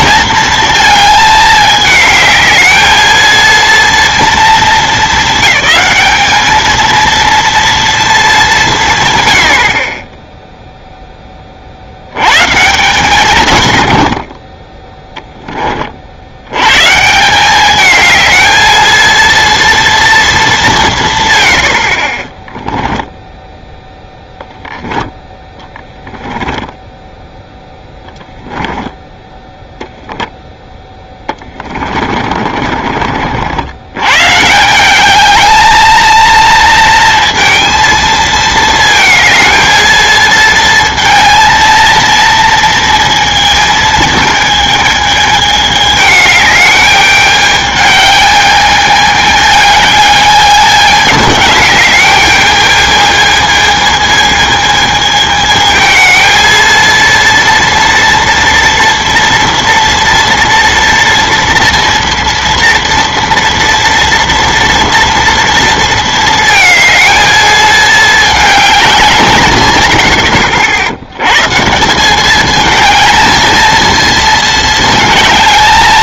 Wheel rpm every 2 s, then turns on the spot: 220, 220, 230, 220, 180, 0, 140, 20, 110, 220, 200, 10, 0, 10, 10, 10, 40, 160, 230, 220, 230, 230, 220, 210, 210, 210, 210, 220, 230, 230, 230, 230, 230, 220, 200, 70, 220, 220.
22-24 26-28 32-34